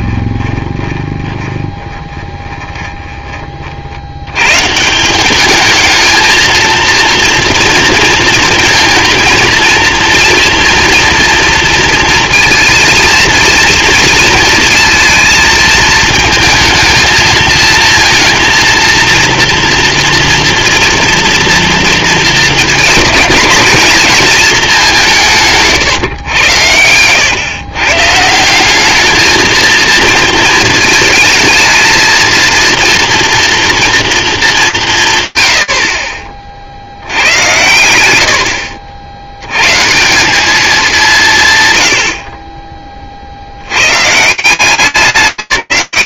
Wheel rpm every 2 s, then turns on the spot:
20, 20, 140, 230, 230, 230, 230, 230, 230, 230, 230, 230, 220, 100, 190, 220, 230, 200, 70, 70, 190, 20, 170.
0-4 26-28